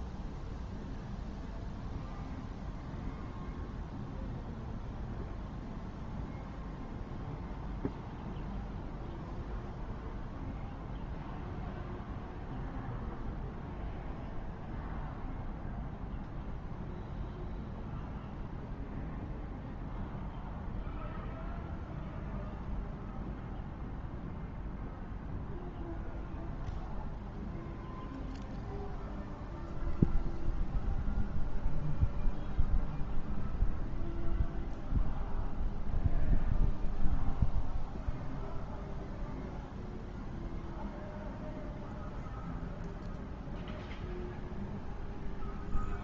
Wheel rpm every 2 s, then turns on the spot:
0, 0, 0, 0, 0, 0, 0, 0, 0, 0, 0, 0, 0, 0, 0, 0, 0, 0, 0, 0, 0, 0, 0.
none